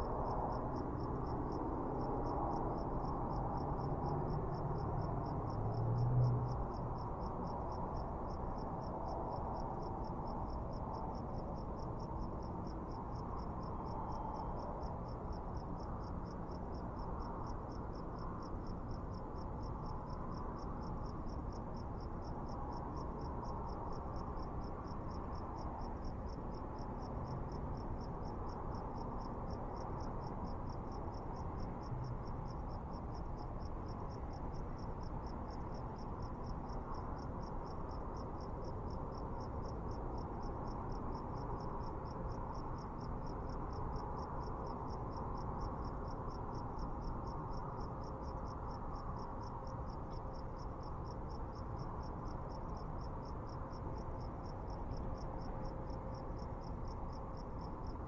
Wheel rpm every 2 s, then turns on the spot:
0, 0, 0, 0, 0, 0, 0, 0, 0, 0, 0, 0, 0, 0, 0, 0, 0, 0, 0, 0, 0, 0, 0, 0, 0, 0, 0, 0, 0.
none